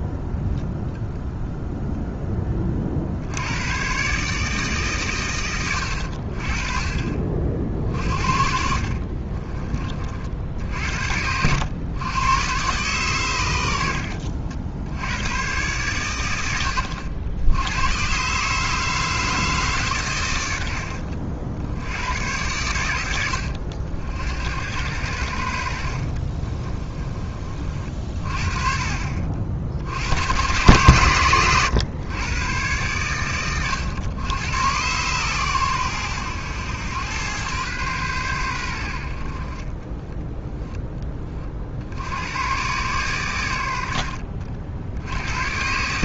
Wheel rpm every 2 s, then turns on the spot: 0, 40, 140, 40, 50, 70, 120, 70, 80, 150, 70, 90, 80, 30, 40, 130, 110, 110, 100, 80, 10, 120, 70.
8-10 20-22 26-28